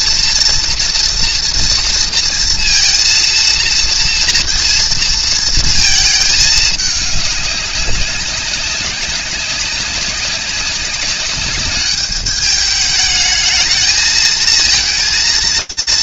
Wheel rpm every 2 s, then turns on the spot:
230, 230, 230, 210, 190, 200, 210, 230.
none